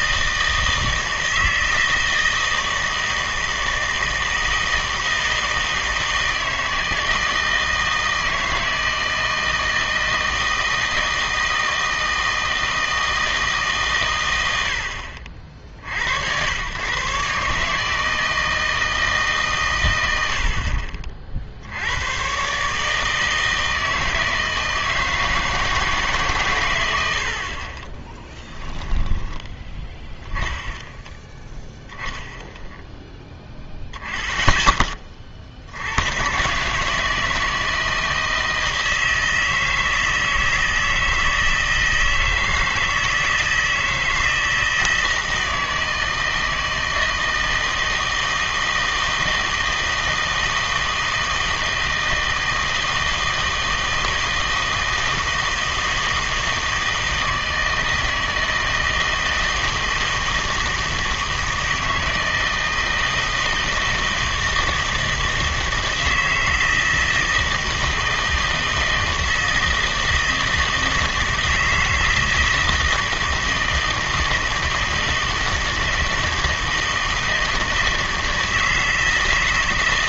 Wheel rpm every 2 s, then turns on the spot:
160, 160, 160, 160, 160, 160, 160, 90, 100, 160, 70, 140, 160, 120, 10, 10, 0, 10, 130, 160, 160, 160, 160, 160, 160, 160, 160, 160, 160, 160, 160, 160, 160, 160, 160, 160, 160, 160, 160, 160.
28-30